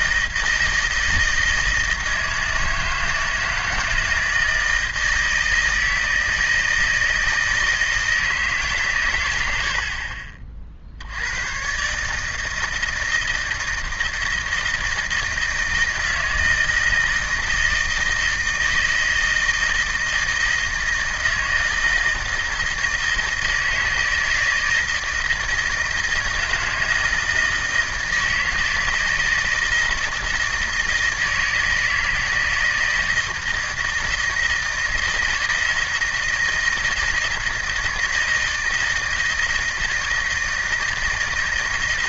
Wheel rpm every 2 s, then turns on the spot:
160, 160, 160, 160, 140, 40, 160, 160, 160, 160, 160, 160, 160, 160, 160, 160, 160, 160, 160, 160, 160.
none